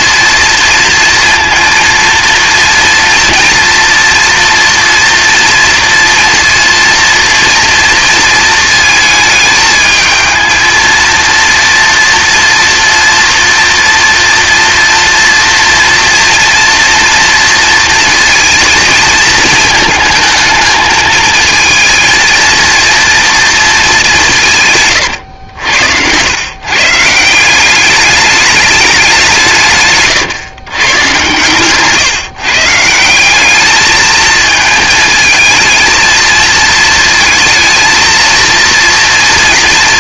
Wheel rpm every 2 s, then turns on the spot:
230, 230, 230, 230, 220, 230, 240, 230, 230, 230, 220, 230, 140, 150, 200, 140, 160, 220, 230, 230.
none